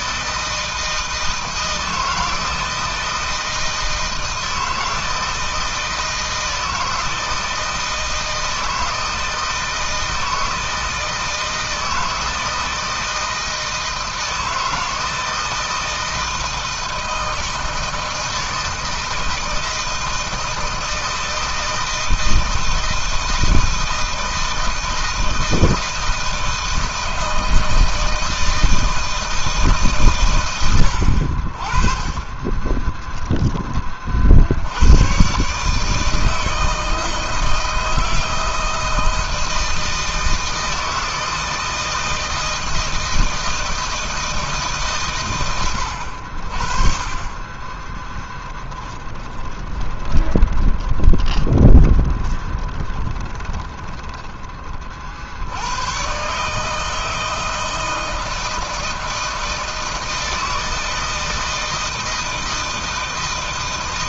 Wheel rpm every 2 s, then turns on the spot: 160, 160, 160, 160, 160, 160, 160, 160, 160, 160, 160, 160, 160, 160, 160, 60, 30, 120, 160, 160, 160, 160, 120, 20, 20, 20, 20, 50, 160, 160, 160, 160.
32-34 48-54